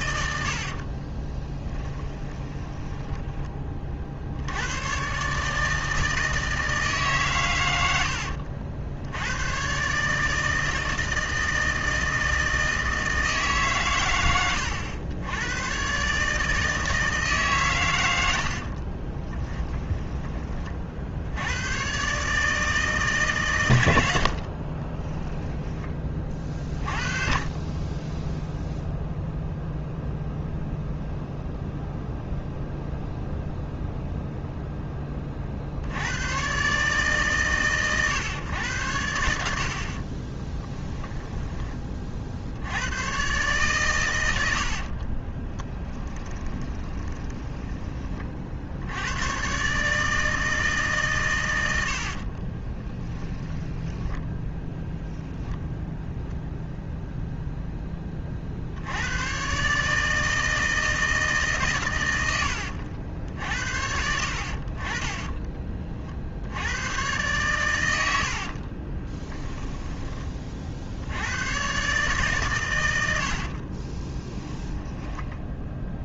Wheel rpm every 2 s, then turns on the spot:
50, 10, 110, 150, 100, 160, 160, 100, 160, 50, 40, 160, 40, 30, 0, 0, 0, 10, 140, 100, 10, 90, 60, 20, 70, 150, 20, 10, 0, 80, 160, 70, 40, 100, 30, 60, 100, 10.
0-4 18-20 24-26 40-42 44-48 52-56 62-64 68-70 72-76